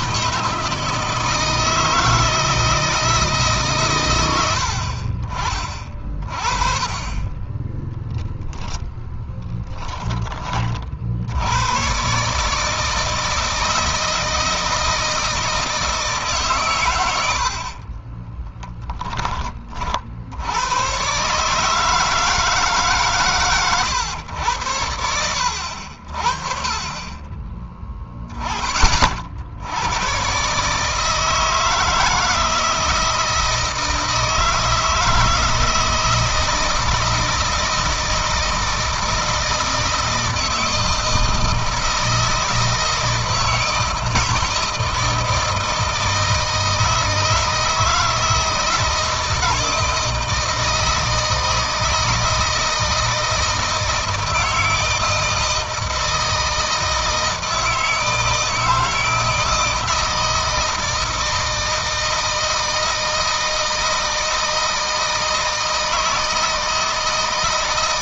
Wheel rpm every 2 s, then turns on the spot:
160, 160, 70, 30, 10, 40, 160, 160, 130, 10, 110, 150, 100, 40, 30, 140, 160, 160, 160, 160, 160, 160, 160, 160, 160, 160, 160, 160, 160, 160, 160, 160, 160, 160.
none